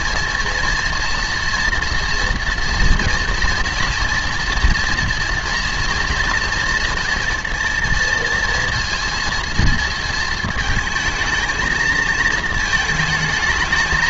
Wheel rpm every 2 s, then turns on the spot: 230, 230, 230, 230, 230, 220, 220.
none